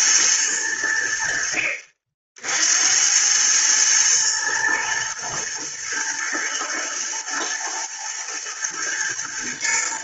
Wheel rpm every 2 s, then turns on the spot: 100, 70, 110, 120, 110.
none